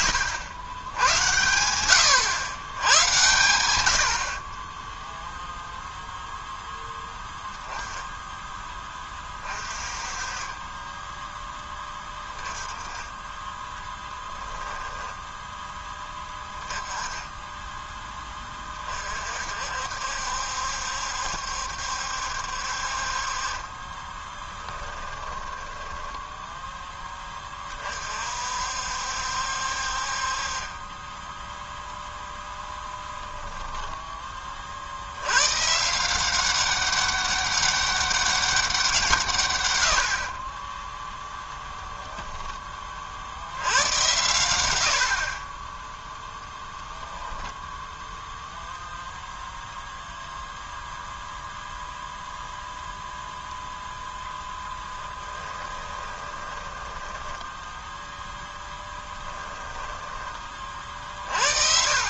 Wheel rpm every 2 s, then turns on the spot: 100, 100, 10, 0, 20, 20, 20, 10, 10, 30, 70, 60, 10, 10, 60, 30, 10, 50, 190, 190, 20, 30, 80, 0, 0, 0, 0, 10, 10, 10, 30.
14-16 24-26 54-58